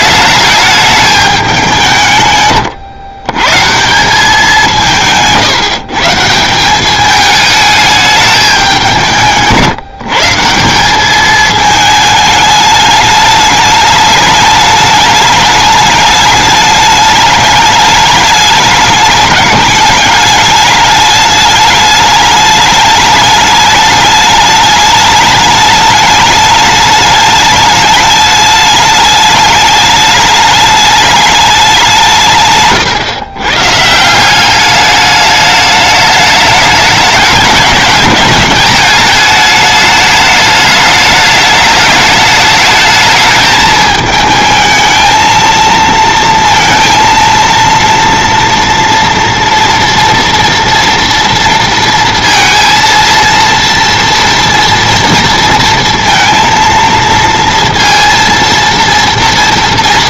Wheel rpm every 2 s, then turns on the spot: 210, 120, 180, 180, 190, 180, 210, 210, 210, 210, 210, 210, 210, 210, 210, 210, 150, 200, 210, 210, 210, 210, 220, 230, 240, 230, 230, 230, 230, 230.
none